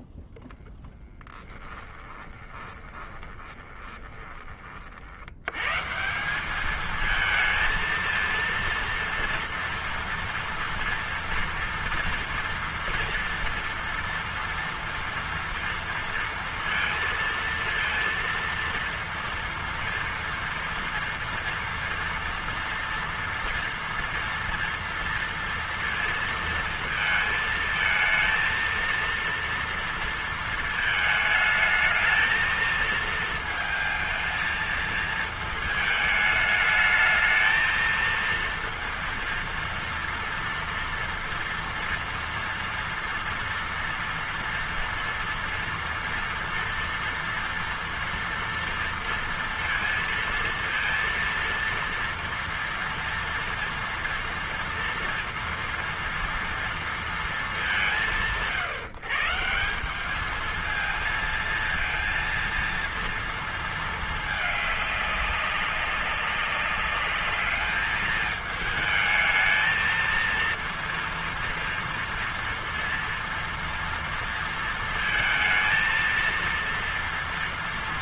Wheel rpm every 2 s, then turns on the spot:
0, 20, 30, 200, 230, 230, 230, 230, 230, 230, 230, 230, 230, 230, 230, 220, 220, 220, 220, 230, 230, 230, 230, 230, 230, 230, 230, 230, 230, 140, 220, 230, 210, 200, 220, 230, 230, 230, 230.
2-4